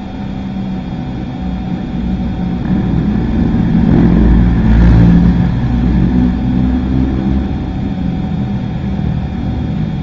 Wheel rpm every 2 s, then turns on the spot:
0, 0, 0, 0, 0.
none